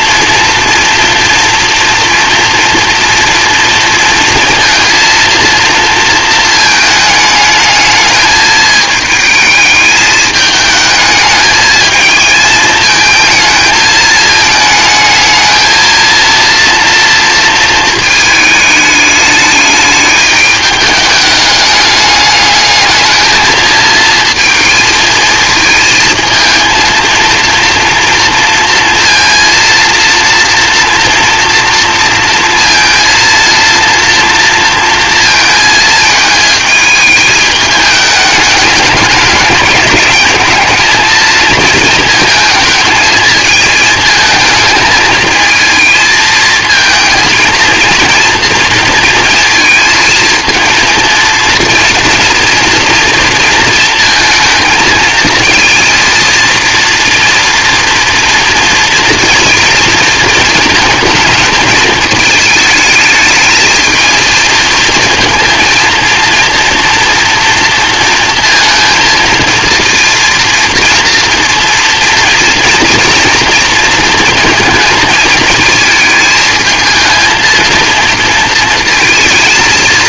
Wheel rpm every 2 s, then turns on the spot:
230, 240, 230, 220, 220, 210, 220, 220, 230, 210, 210, 210, 230, 230, 230, 240, 230, 230, 220, 210, 220, 220, 220, 220, 230, 230, 230, 220, 230, 230, 220, 220, 220, 230, 230, 230, 230, 220, 220, 220.
none